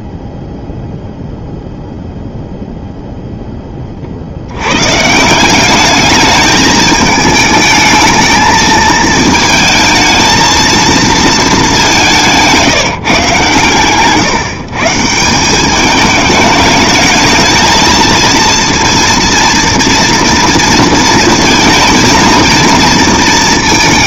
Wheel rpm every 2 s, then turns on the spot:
0, 0, 120, 220, 220, 220, 180, 140, 210, 230, 230, 230.
none